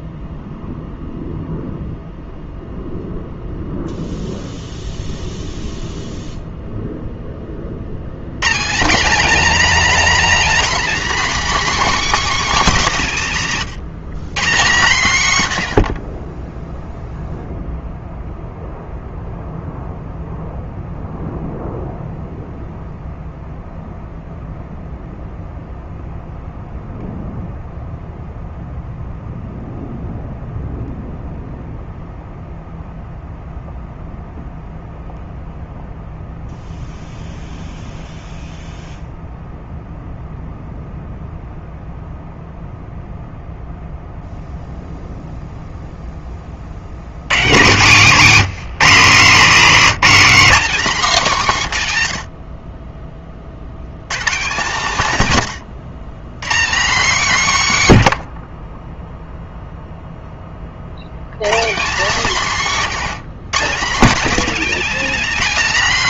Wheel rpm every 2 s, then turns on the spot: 0, 0, 0, 0, 190, 290, 270, 160, 0, 0, 0, 0, 0, 0, 0, 0, 0, 0, 0, 0, 0, 0, 0, 60, 180, 270, 50, 160, 190, 40, 50, 190, 260.
none